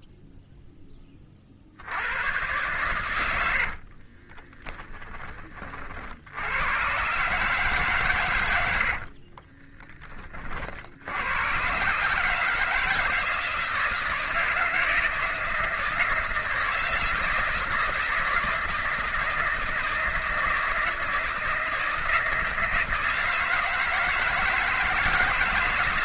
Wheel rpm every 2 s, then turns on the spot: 10, 110, 20, 90, 90, 50, 160, 160, 160, 160, 160, 160, 160.
4-6